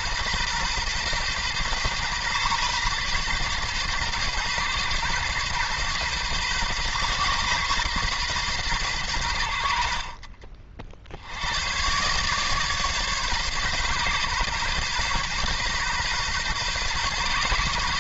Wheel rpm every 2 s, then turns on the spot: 130, 130, 130, 130, 120, 50, 150, 130, 130.
none